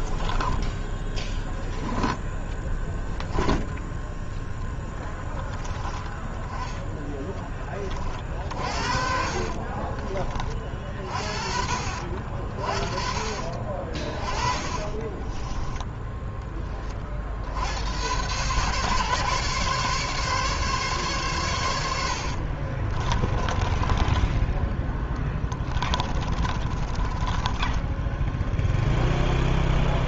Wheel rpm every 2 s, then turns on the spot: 20, 10, 10, 10, 50, 40, 50, 20, 30, 130, 140, 40, 10, 30, 0.
0-2 8-10 14-16 22-24 26-28